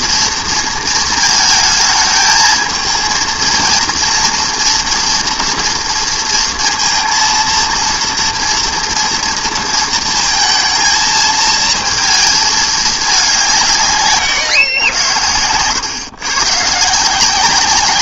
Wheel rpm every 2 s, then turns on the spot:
220, 220, 230, 230, 230, 220, 210, 110, 140.
none